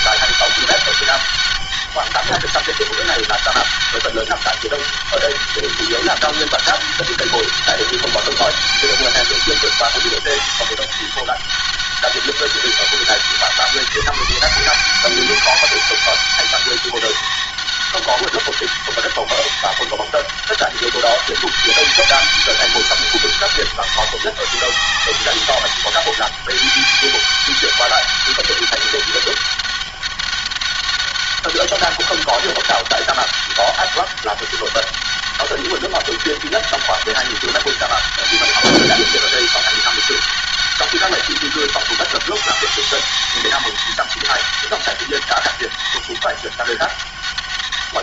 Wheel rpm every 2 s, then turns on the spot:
200, 200, 200, 200, 200, 200, 190, 170, 200, 200, 200, 200, 200, 200, 200, 200, 200, 200, 190, 200, 200, 200, 200, 200.
none